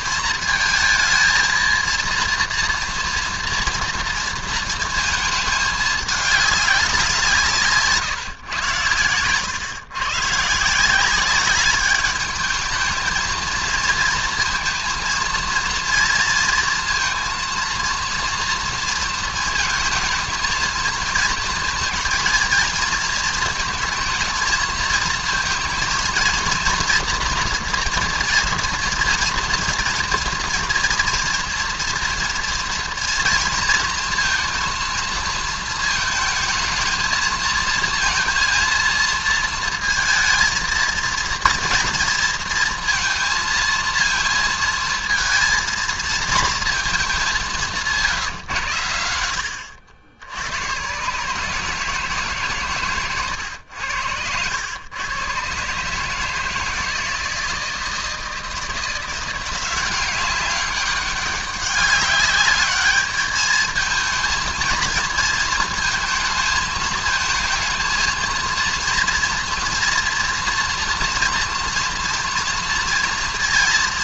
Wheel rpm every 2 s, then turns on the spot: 230, 230, 220, 190, 110, 160, 220, 230, 230, 230, 220, 230, 220, 230, 230, 240, 230, 230, 220, 230, 230, 230, 220, 220, 120, 130, 130, 100, 160, 170, 200, 210, 220, 220, 230, 230, 230.
none